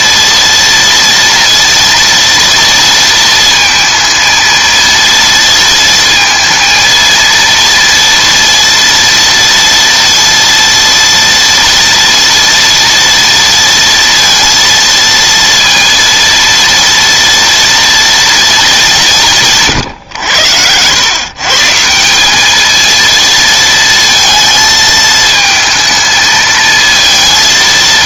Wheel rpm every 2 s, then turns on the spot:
230, 230, 230, 230, 230, 230, 230, 230, 230, 210, 100, 220, 220, 220.
none